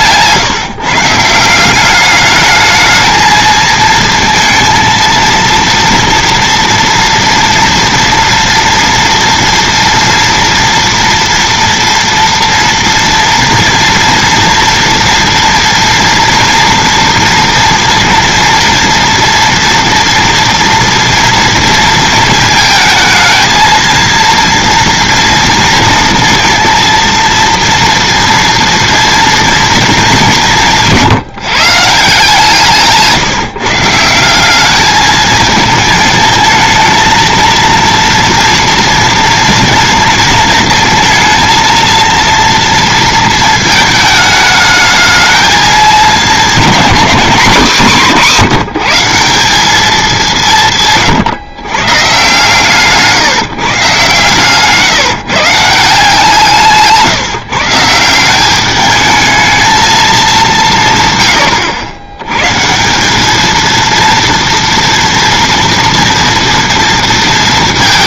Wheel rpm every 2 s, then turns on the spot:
150, 210, 230, 230, 230, 230, 230, 230, 230, 230, 230, 220, 230, 230, 230, 170, 160, 200, 220, 230, 230, 230, 220, 240, 180, 160, 140, 140, 150, 200, 160, 150, 230, 230.
30-32